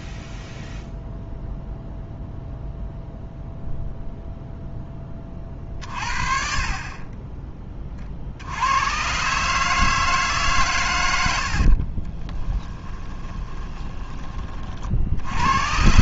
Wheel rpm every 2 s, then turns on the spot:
0, 0, 0, 40, 90, 130, 20, 40.
12-14